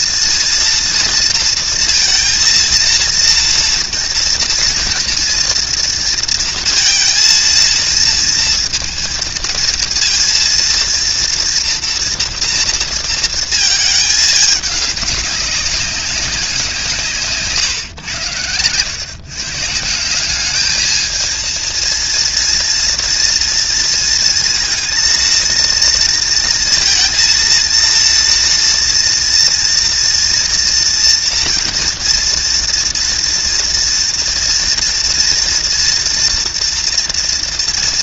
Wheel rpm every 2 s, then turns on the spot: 230, 230, 240, 230, 230, 230, 230, 210, 170, 110, 210, 230, 230, 230, 230, 240, 230, 230, 240.
none